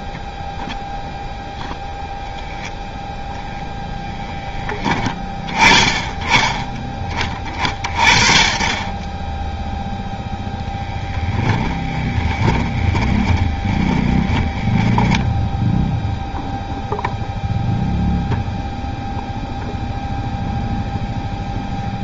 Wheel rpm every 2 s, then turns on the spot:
0, 0, 10, 20, 20, 10, 20, 10, 0, 0, 0.
10-16